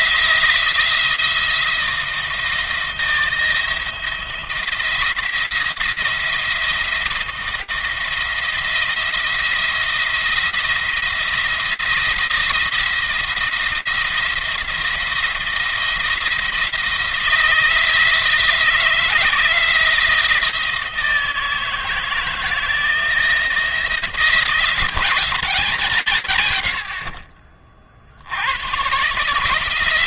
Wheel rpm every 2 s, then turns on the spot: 170, 170, 170, 170, 170, 170, 170, 170, 170, 170, 160, 160, 170, 100, 120.
none